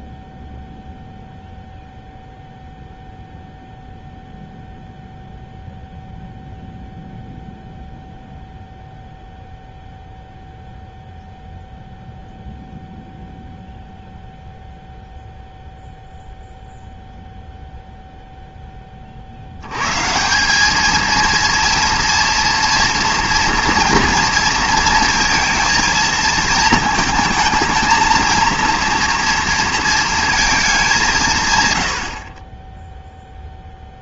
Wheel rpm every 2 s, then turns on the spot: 0, 0, 0, 0, 0, 0, 0, 0, 0, 10, 190, 230, 230, 220, 230, 220, 30.
none